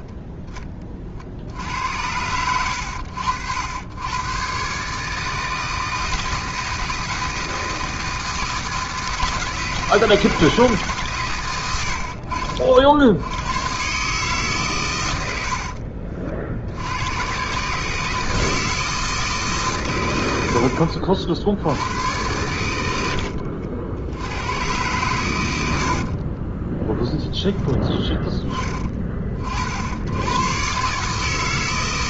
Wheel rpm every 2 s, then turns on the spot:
20, 80, 120, 160, 160, 150, 50, 140, 70, 160, 70, 100, 100, 30, 20, 120.
20-22 26-28